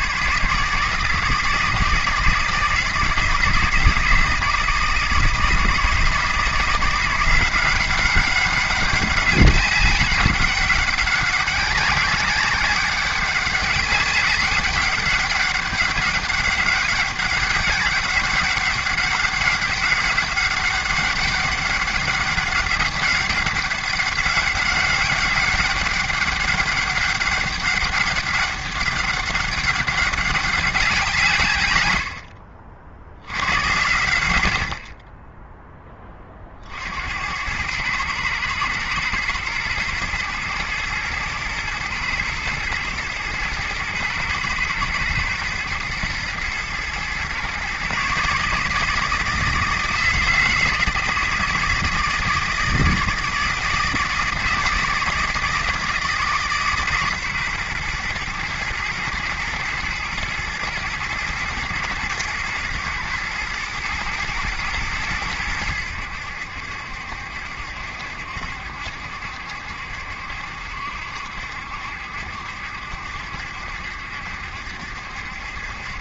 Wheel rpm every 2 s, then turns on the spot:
160, 160, 160, 180, 200, 190, 200, 200, 200, 190, 200, 200, 200, 200, 200, 170, 60, 40, 70, 120, 110, 110, 110, 120, 160, 160, 160, 160, 140, 120, 120, 120, 110, 70, 70, 70, 70, 70.
none